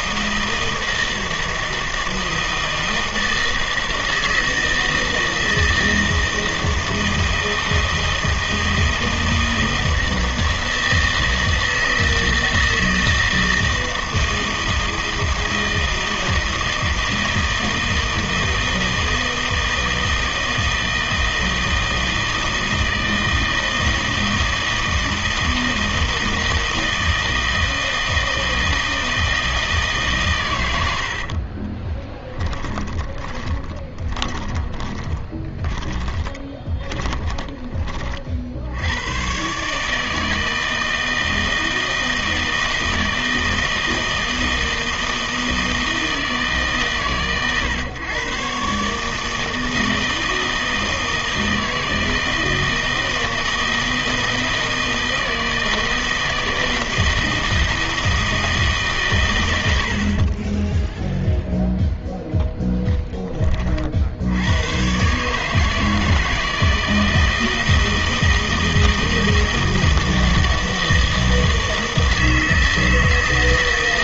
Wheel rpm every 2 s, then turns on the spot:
160, 160, 160, 160, 160, 160, 160, 160, 160, 160, 160, 160, 160, 160, 160, 100, 10, 20, 20, 90, 160, 160, 160, 140, 140, 160, 160, 160, 160, 150, 10, 0, 110, 160, 160, 160, 160.
32-38